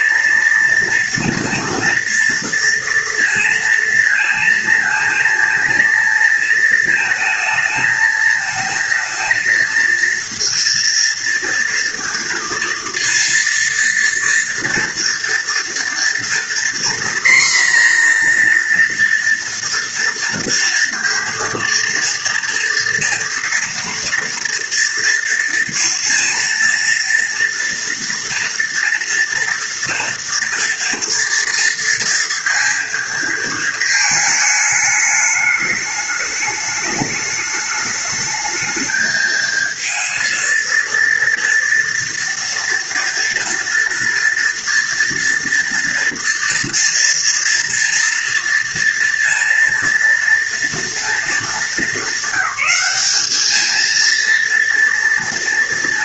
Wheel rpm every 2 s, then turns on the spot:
230, 230, 230, 220, 230, 230, 230, 230, 240, 230, 230, 230, 230, 230, 230, 230, 230, 210, 210, 220, 230, 230, 240, 230, 230, 230, 210, 230.
none